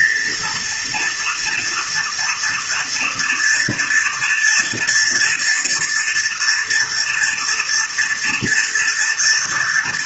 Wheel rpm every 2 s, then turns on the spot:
230, 240, 230, 240, 230.
none